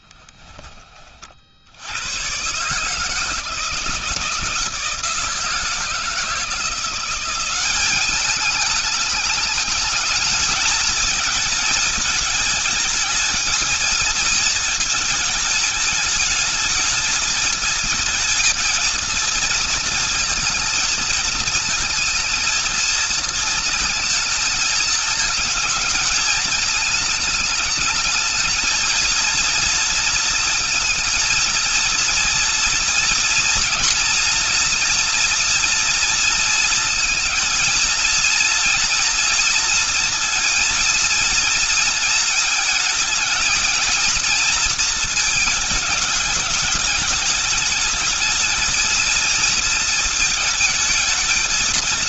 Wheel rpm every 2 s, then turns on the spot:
30, 150, 160, 180, 210, 220, 220, 220, 220, 230, 230, 220, 220, 220, 220, 230, 240, 230, 230, 230, 230, 220, 230, 220, 230, 220.
none